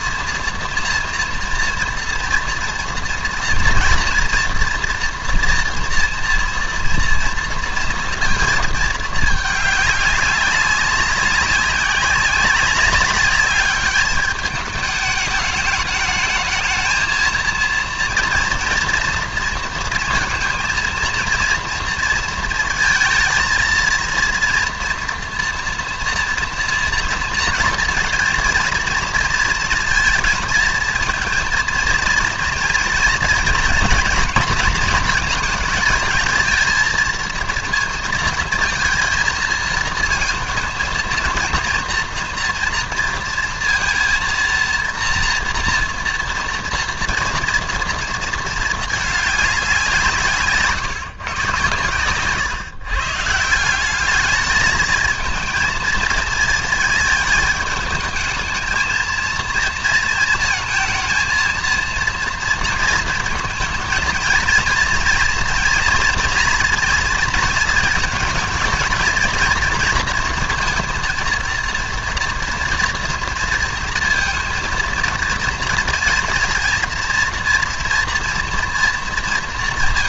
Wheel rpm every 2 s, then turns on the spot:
230, 230, 230, 230, 220, 200, 190, 210, 220, 230, 230, 230, 230, 230, 230, 220, 230, 240, 230, 230, 230, 240, 240, 230, 220, 140, 140, 220, 220, 220, 220, 230, 230, 230, 220, 230, 230, 230, 230, 230.
none